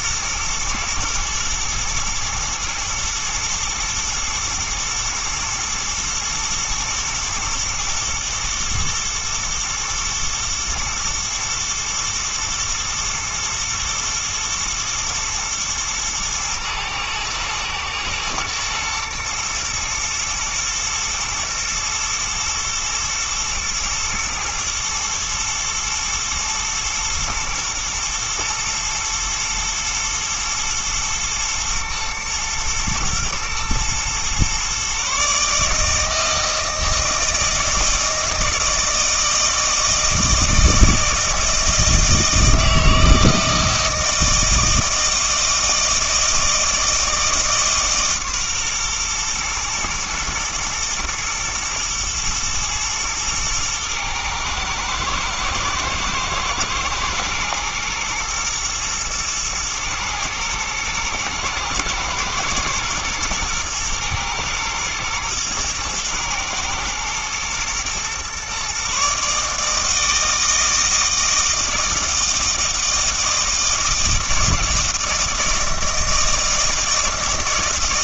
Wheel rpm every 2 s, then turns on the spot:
110, 110, 110, 110, 110, 120, 120, 120, 110, 110, 110, 110, 120, 110, 120, 120, 110, 130, 160, 160, 160, 160, 160, 160, 130, 120, 120, 110, 110, 110, 110, 120, 110, 110, 130, 160, 160, 160, 160.
none